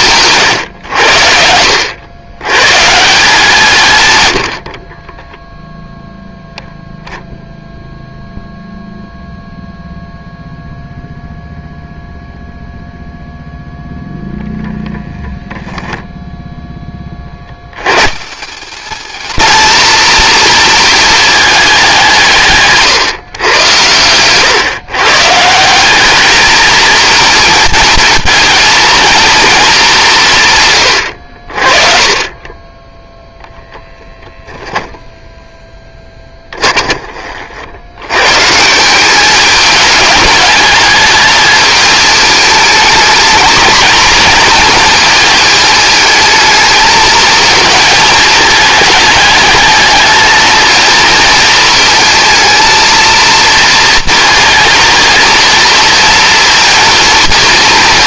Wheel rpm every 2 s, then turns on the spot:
110, 140, 30, 10, 0, 0, 0, 0, 20, 190, 230, 140, 130, 220, 230, 120, 20, 0, 20, 170, 210, 220, 230, 220, 210, 230, 230, 230, 230.
none